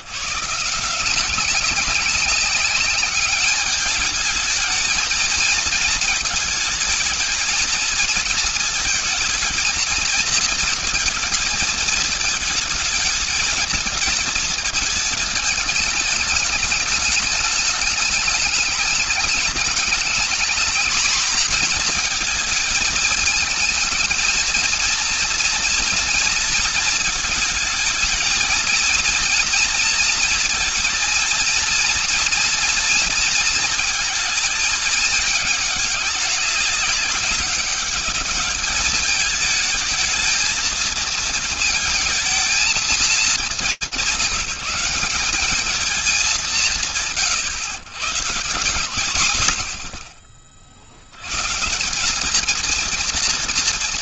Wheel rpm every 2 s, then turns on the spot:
150, 200, 220, 220, 230, 230, 220, 220, 210, 210, 230, 220, 230, 230, 220, 230, 230, 220, 200, 210, 220, 230, 190, 190, 130, 50, 220.
none